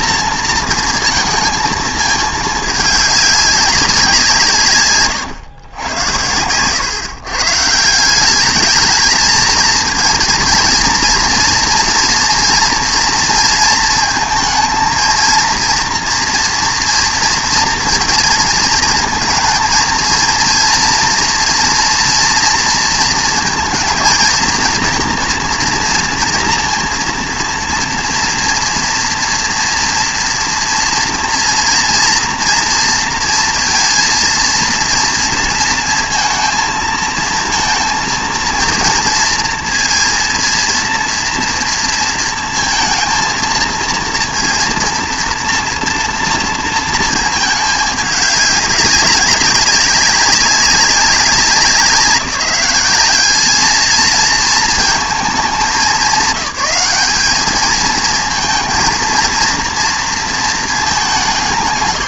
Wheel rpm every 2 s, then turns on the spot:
230, 220, 150, 110, 210, 230, 230, 220, 230, 220, 230, 230, 230, 230, 230, 230, 230, 230, 220, 230, 230, 230, 230, 230, 200, 190, 190, 220, 200, 230, 230.
none